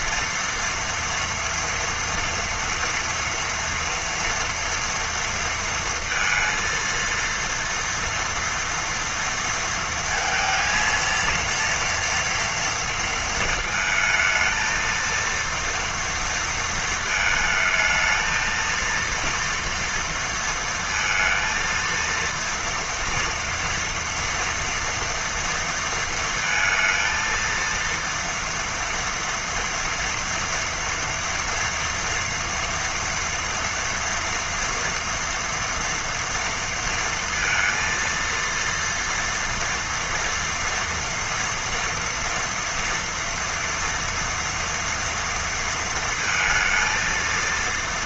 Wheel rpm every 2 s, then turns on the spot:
230, 240, 230, 230, 230, 230, 230, 230, 220, 230, 230, 230, 240, 230, 240, 230, 230, 230, 230, 230, 240, 230, 230, 230.
none